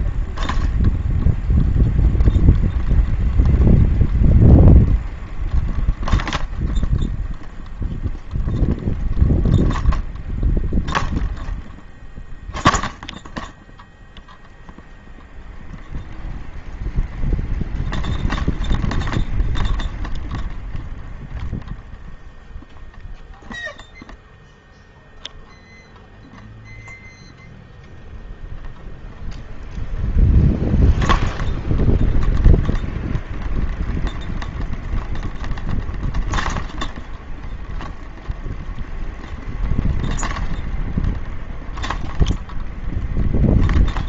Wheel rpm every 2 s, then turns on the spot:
0, 0, 0, 0, 0, 0, 0, 0, 0, 0, 0, 0, 0, 0, 0, 0, 0, 0, 0, 0, 0, 0.
none